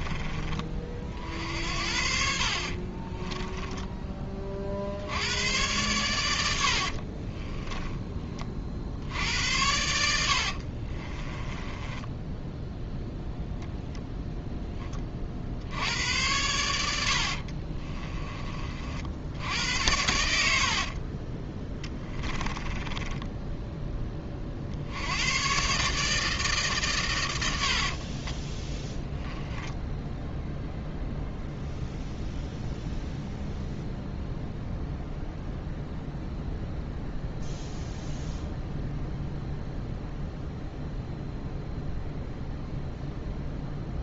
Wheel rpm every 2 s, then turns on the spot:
40, 50, 50, 60, 60, 50, 0, 10, 90, 40, 60, 10, 60, 140, 10, 0, 0, 0, 0, 0, 0, 0.
2-4 6-8 10-12 22-24 28-30